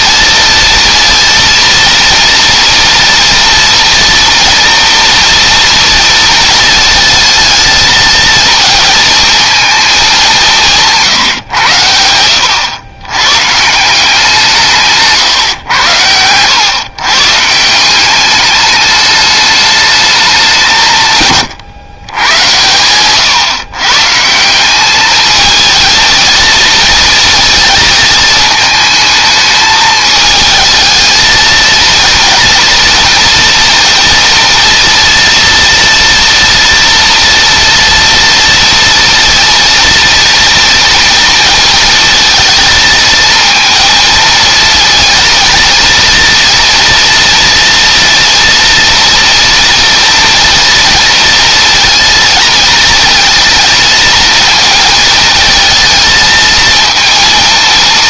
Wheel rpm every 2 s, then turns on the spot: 230, 230, 240, 220, 220, 150, 100, 150, 130, 210, 150, 130, 210, 230, 220, 220, 230, 230, 230, 230, 230, 220, 230, 230, 240, 230, 230, 220, 230.
none